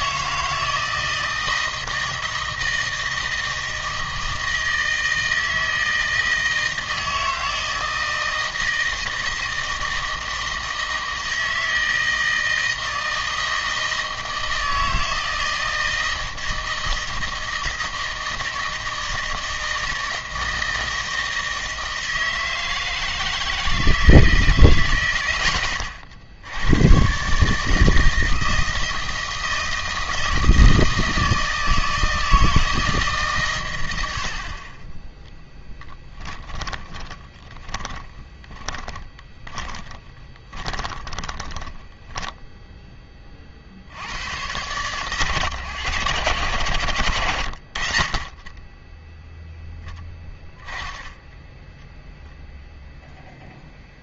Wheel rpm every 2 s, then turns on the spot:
160, 160, 160, 160, 160, 160, 160, 160, 160, 160, 160, 160, 140, 90, 160, 160, 160, 40, 20, 20, 20, 10, 120, 100, 20, 10, 0.
36-42